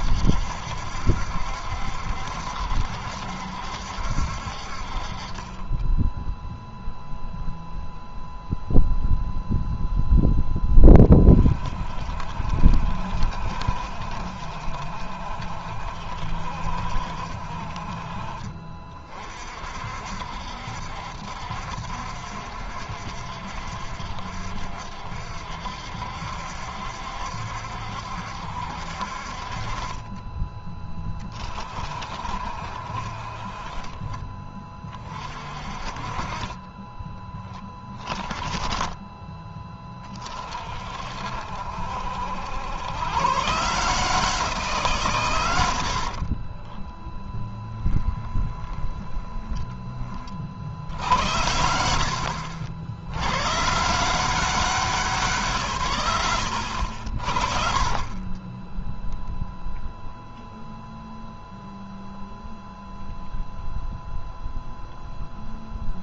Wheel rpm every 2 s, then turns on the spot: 70, 80, 50, 0, 0, 20, 70, 70, 60, 50, 70, 70, 70, 70, 60, 20, 60, 40, 20, 20, 60, 120, 150, 10, 10, 80, 90, 170, 70, 10, 0, 0, 0.
38-40 46-50 56-60